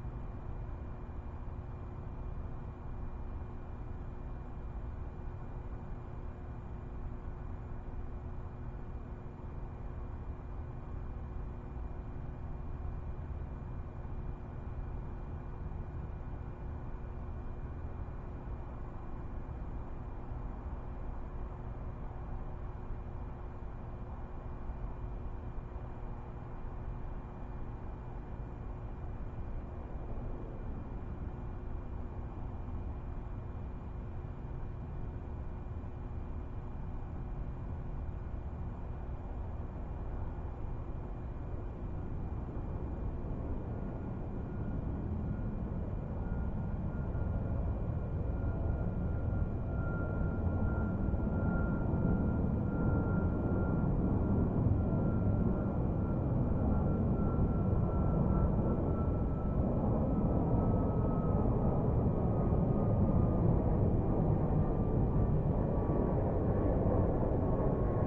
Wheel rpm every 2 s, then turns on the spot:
0, 0, 0, 0, 0, 0, 0, 0, 0, 0, 0, 0, 0, 0, 0, 0, 0, 0, 0, 0, 0, 0, 0, 0, 0, 0, 0, 0, 0, 0, 0, 0, 0, 0.
none